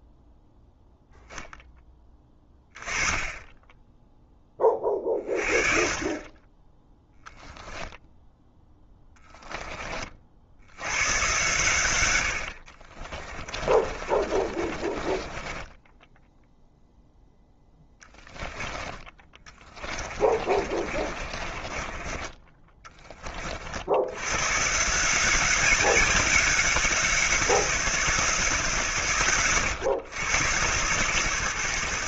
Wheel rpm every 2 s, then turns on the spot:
0, 20, 30, 10, 10, 80, 50, 30, 0, 10, 40, 20, 150, 190, 140, 120.
8-10 12-16 18-22